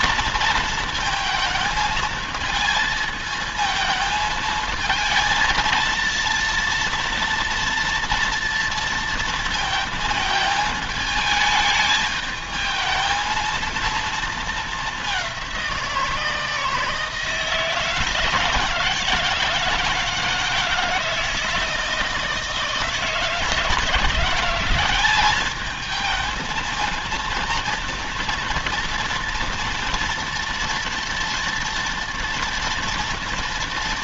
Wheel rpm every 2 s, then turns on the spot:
230, 220, 220, 230, 230, 220, 220, 210, 160, 160, 160, 160, 180, 230, 230, 230, 230.
none